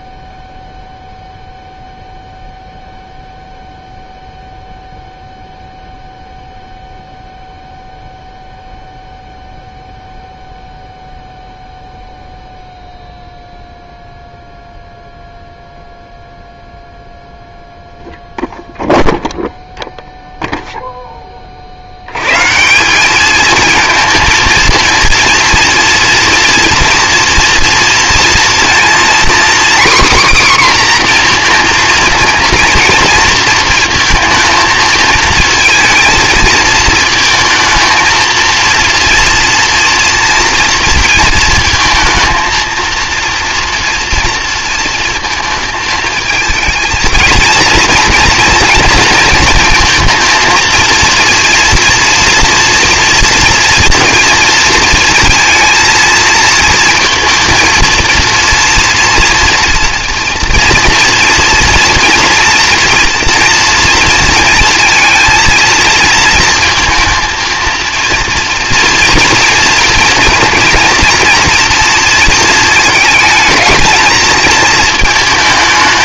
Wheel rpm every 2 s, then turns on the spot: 0, 0, 0, 0, 0, 0, 0, 0, 0, 0, 0, 170, 230, 230, 240, 260, 230, 230, 220, 230, 230, 230, 230, 220, 230, 230, 230, 230, 230, 240, 230, 230, 230, 230, 230, 240, 220, 230.
none